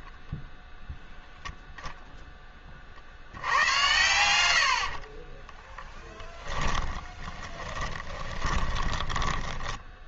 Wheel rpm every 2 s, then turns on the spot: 0, 40, 70, 10, 20.
4-10